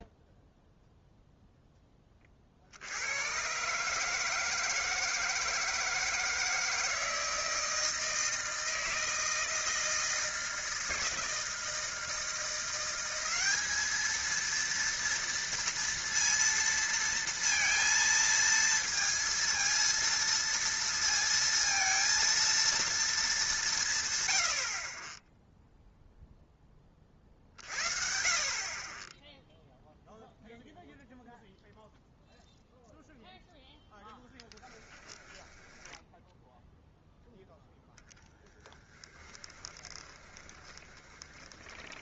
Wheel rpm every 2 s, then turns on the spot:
0, 50, 160, 160, 160, 160, 170, 230, 230, 230, 230, 230, 60, 10, 40, 0, 0, 10, 0, 10, 20.
34-36 38-42